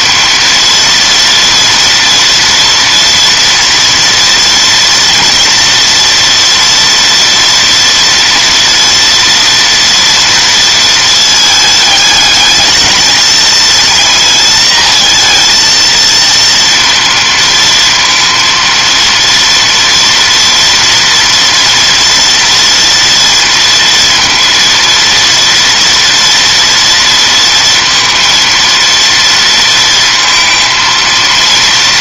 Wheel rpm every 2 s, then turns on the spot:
230, 230, 240, 240, 230, 230, 220, 230, 230, 230, 230, 230, 230, 230, 230, 230.
none